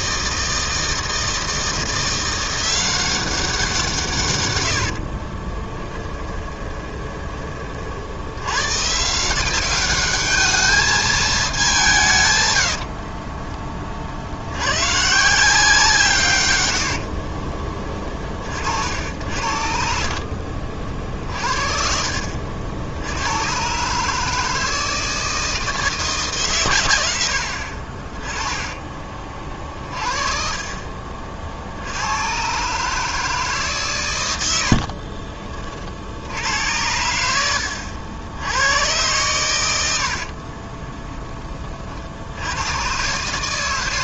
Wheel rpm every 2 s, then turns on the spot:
160, 180, 90, 20, 130, 210, 80, 110, 80, 60, 50, 70, 160, 120, 20, 40, 140, 60, 90, 90, 20, 120.
4-8 12-14 16-18 28-30 34-36 40-42